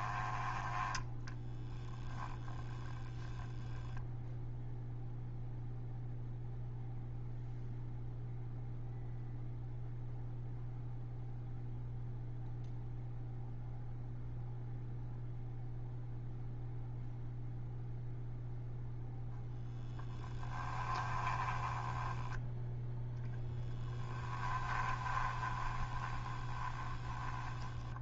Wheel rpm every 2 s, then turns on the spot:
10, 10, 0, 0, 0, 0, 0, 0, 0, 0, 10, 0, 20, 10.
2-4 20-22 24-28